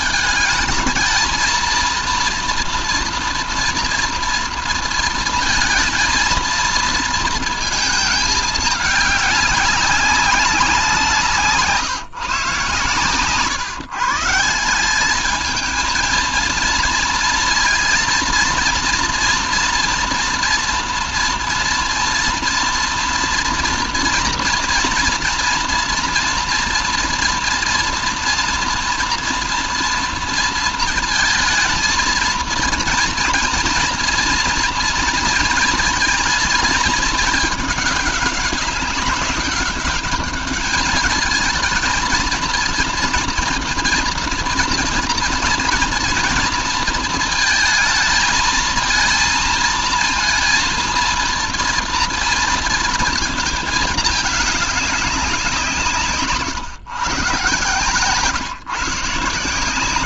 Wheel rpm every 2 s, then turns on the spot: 220, 230, 230, 230, 210, 180, 140, 190, 230, 230, 240, 240, 230, 230, 230, 220, 230, 230, 220, 200, 210, 230, 230, 230, 230, 230, 230, 200, 140, 140.
none